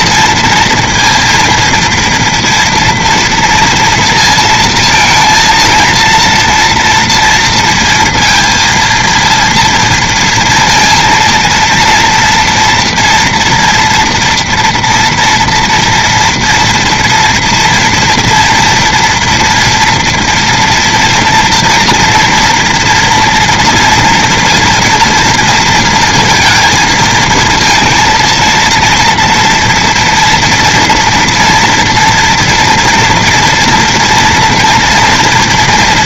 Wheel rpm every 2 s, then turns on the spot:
230, 230, 230, 230, 230, 230, 230, 230, 230, 240, 230, 230, 230, 230, 230, 230, 230, 230.
none